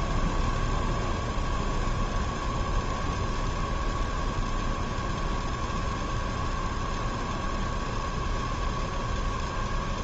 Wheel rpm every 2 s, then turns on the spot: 0, 0, 0, 0, 0.
none